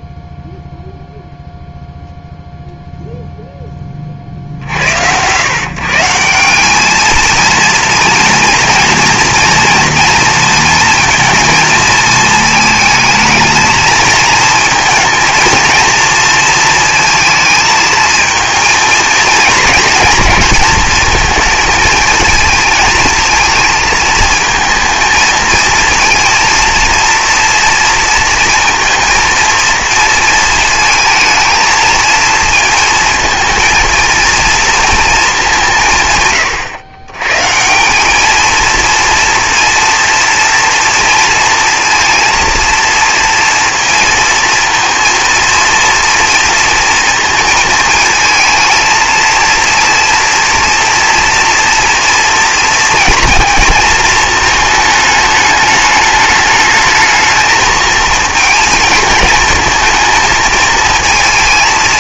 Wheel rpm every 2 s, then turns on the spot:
0, 0, 70, 200, 240, 230, 220, 230, 230, 230, 220, 220, 230, 230, 230, 230, 230, 230, 130, 230, 230, 230, 230, 230, 230, 230, 230, 220, 220, 220, 220.
none